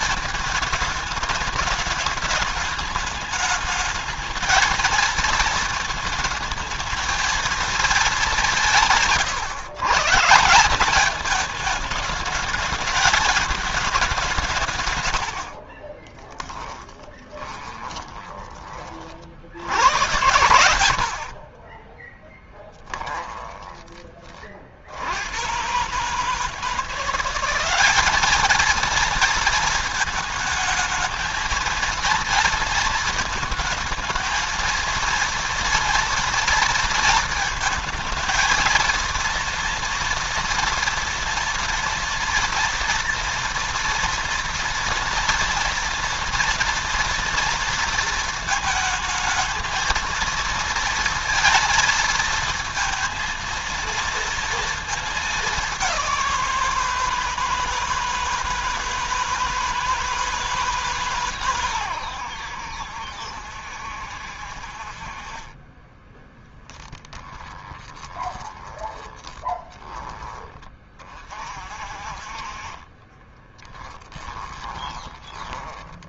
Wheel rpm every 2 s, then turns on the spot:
210, 210, 220, 220, 170, 200, 210, 120, 20, 40, 90, 10, 70, 170, 230, 220, 230, 230, 230, 230, 230, 230, 230, 230, 220, 230, 230, 220, 170, 160, 150, 80, 50, 20, 20, 30, 30, 20.
14-18 22-24 66-70 72-76